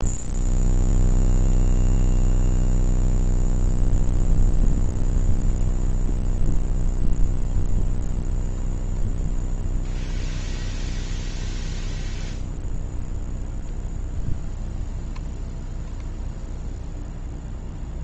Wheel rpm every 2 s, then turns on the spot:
0, 0, 0, 0, 0, 0, 0, 0, 0.
none